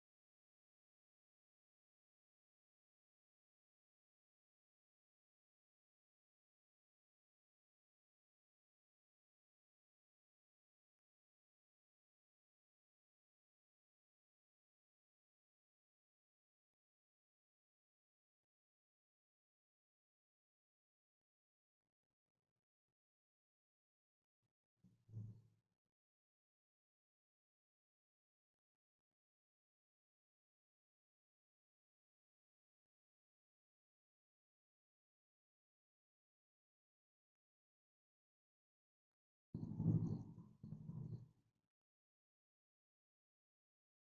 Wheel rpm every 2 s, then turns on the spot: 0, 0, 0, 0, 0, 0, 0, 0, 0, 0, 0, 0, 0, 0, 0, 0, 0, 0, 0, 0, 0, 0.
none